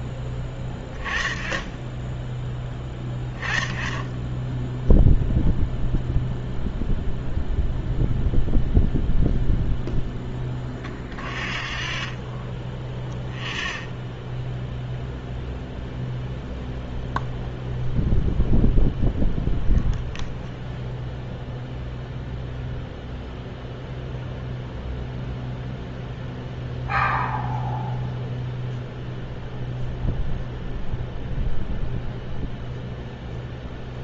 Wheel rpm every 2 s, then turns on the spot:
10, 10, 0, 0, 0, 0, 0, 0, 0, 0, 0, 0, 0, 0, 0, 0, 0.
none